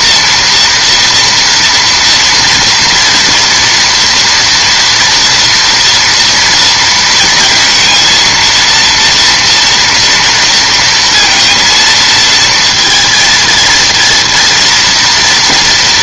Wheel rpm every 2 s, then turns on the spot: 230, 230, 230, 230, 230, 230, 220, 230.
none